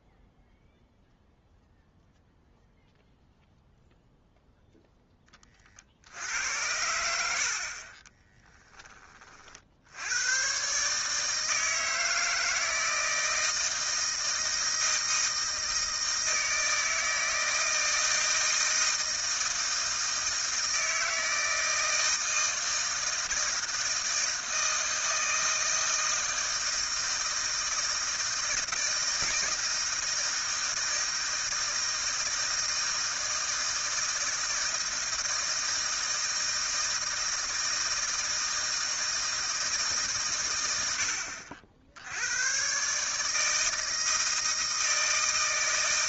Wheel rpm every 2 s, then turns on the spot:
0, 0, 0, 80, 10, 120, 160, 160, 160, 160, 160, 160, 160, 160, 160, 160, 160, 160, 160, 160, 90, 110, 160.
none